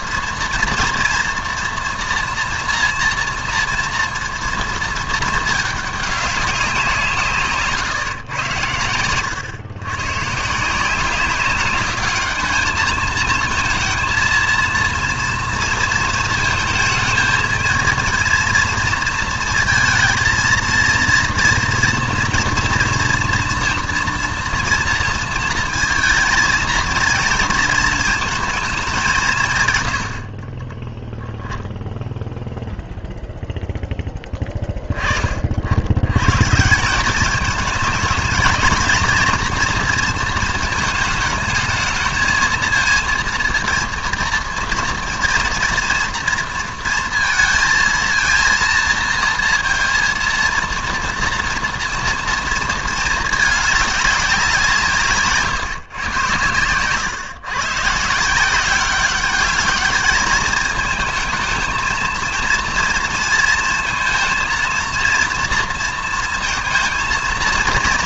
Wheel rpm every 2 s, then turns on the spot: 230, 230, 230, 180, 110, 170, 220, 230, 220, 230, 230, 230, 230, 230, 210, 10, 0, 20, 170, 230, 230, 230, 230, 230, 230, 230, 230, 170, 120, 190, 220, 230, 230, 230.
none